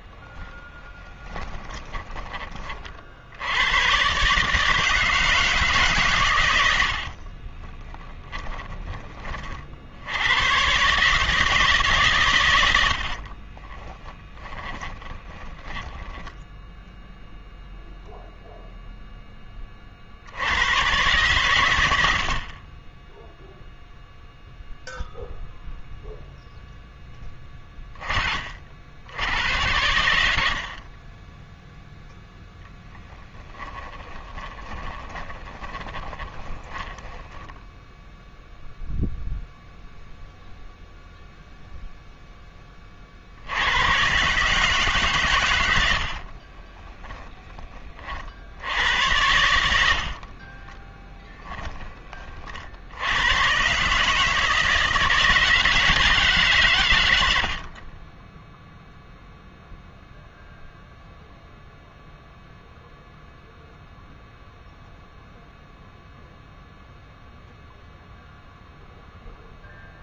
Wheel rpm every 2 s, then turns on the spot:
30, 40, 150, 70, 20, 140, 70, 20, 10, 0, 110, 10, 0, 0, 70, 40, 0, 20, 10, 0, 0, 30, 140, 20, 80, 20, 70, 160, 110, 0, 0, 0, 0, 0, 0.
0-2 6-8 14-16 34-38 46-48 50-52